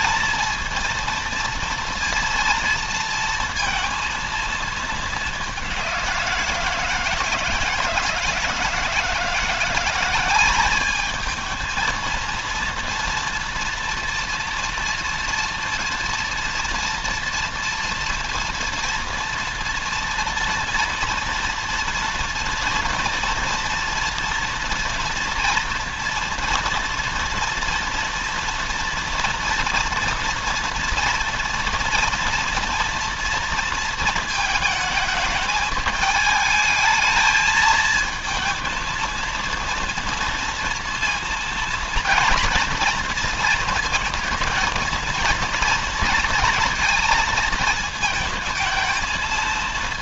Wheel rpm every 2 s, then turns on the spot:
230, 230, 210, 160, 170, 210, 230, 230, 230, 230, 230, 230, 230, 230, 230, 230, 230, 220, 220, 230, 230, 230, 230, 230, 220.
none